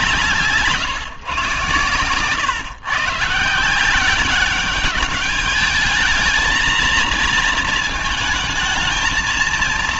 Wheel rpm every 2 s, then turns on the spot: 160, 130, 200, 230, 220.
none